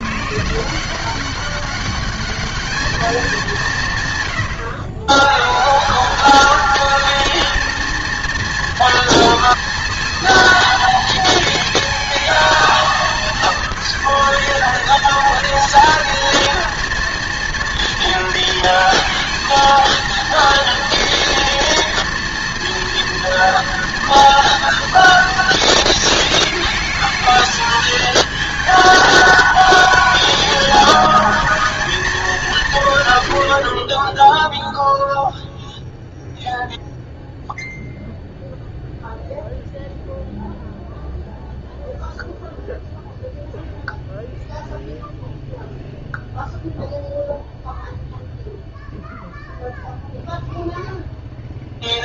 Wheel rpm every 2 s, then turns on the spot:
180, 210, 110, 220, 230, 230, 230, 230, 230, 220, 240, 230, 230, 220, 220, 220, 180, 0, 0, 0, 0, 0, 0, 0, 0, 0.
none